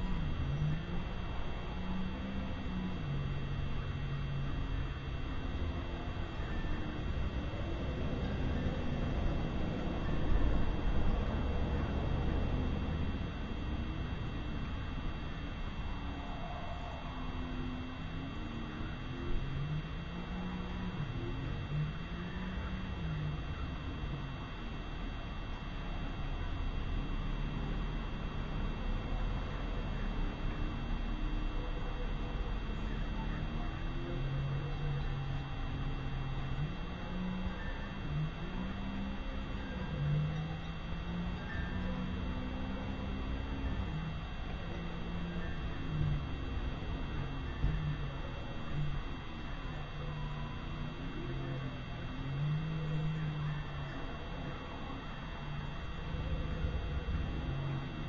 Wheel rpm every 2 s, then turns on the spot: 0, 0, 0, 0, 0, 0, 0, 0, 0, 0, 0, 0, 0, 0, 0, 0, 0, 0, 0, 0, 0, 0, 0, 0, 0, 0, 0, 0, 0.
none